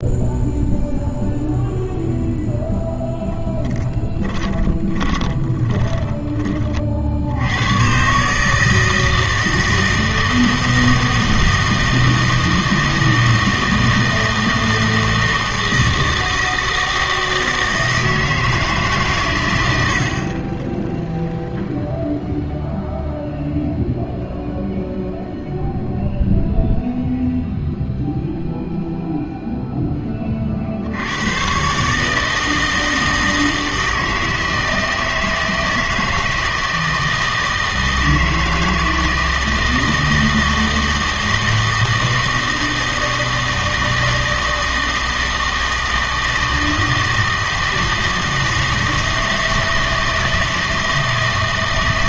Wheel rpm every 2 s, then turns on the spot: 0, 0, 20, 30, 160, 160, 160, 160, 160, 160, 20, 0, 0, 0, 0, 60, 160, 160, 160, 160, 160, 160, 160, 160, 160, 160.
4-6